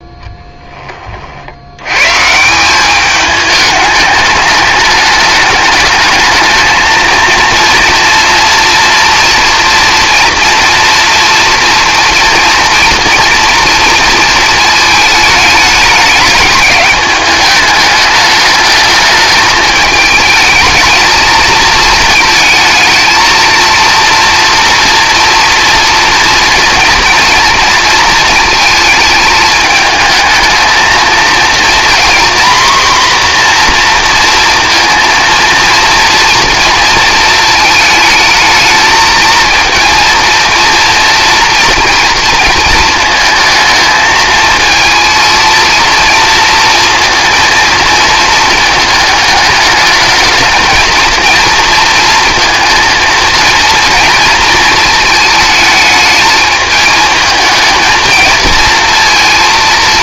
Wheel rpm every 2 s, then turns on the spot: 10, 170, 210, 220, 230, 230, 230, 220, 210, 210, 220, 220, 230, 230, 230, 220, 250, 230, 230, 220, 230, 230, 230, 230, 220, 220, 230, 220, 220, 230.
none